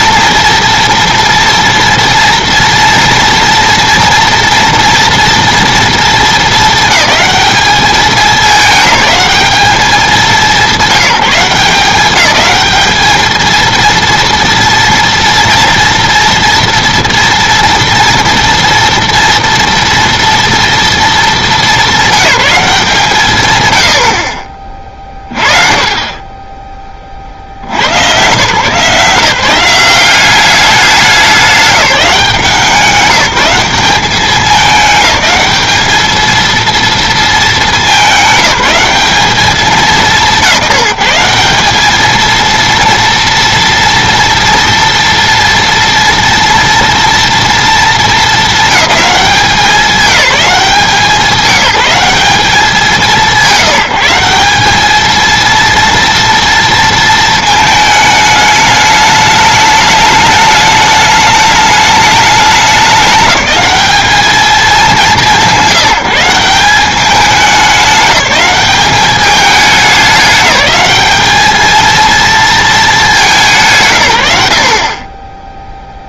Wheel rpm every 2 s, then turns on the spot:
230, 230, 230, 220, 210, 180, 210, 230, 230, 230, 230, 180, 30, 10, 140, 200, 180, 210, 230, 190, 170, 230, 240, 230, 210, 190, 180, 200, 230, 210, 210, 200, 190, 190, 200, 210, 220, 70.
none